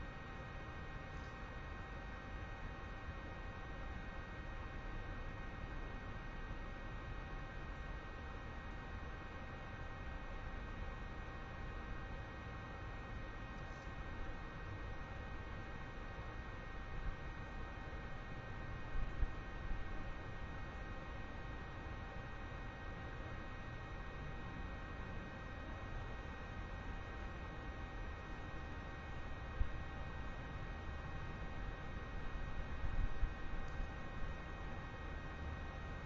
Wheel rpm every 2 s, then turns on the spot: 0, 0, 0, 0, 0, 0, 0, 0, 0, 0, 0, 0, 0, 0, 0, 0, 0, 0.
none